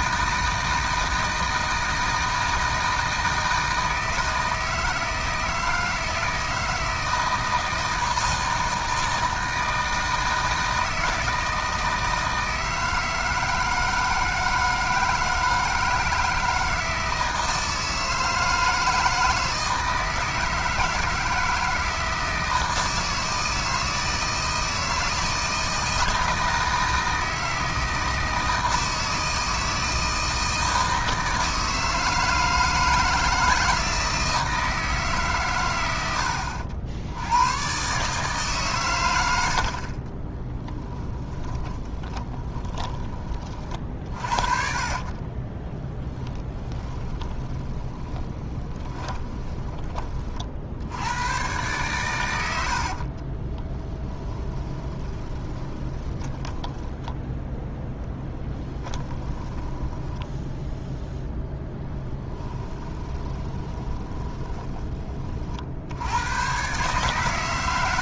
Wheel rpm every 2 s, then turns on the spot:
160, 160, 160, 160, 160, 160, 160, 160, 160, 160, 160, 160, 160, 160, 160, 160, 160, 160, 80, 120, 20, 20, 40, 20, 20, 70, 60, 10, 10, 10, 0, 20, 20, 130.
40-42 44-50 52-56 58-60 62-64